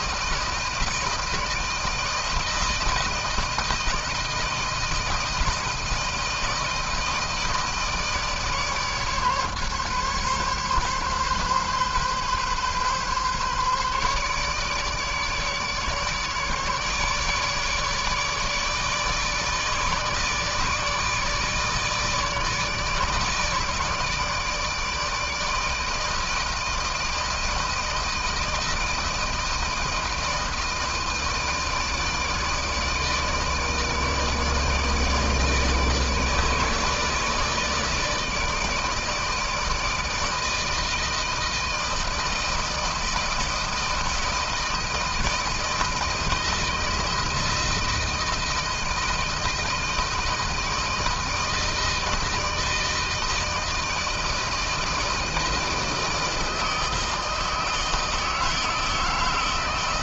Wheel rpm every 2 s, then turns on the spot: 160, 160, 160, 160, 160, 140, 130, 150, 150, 150, 150, 150, 160, 160, 160, 160, 160, 150, 150, 160, 160, 160, 160, 160, 160, 160, 160, 160, 160, 160.
none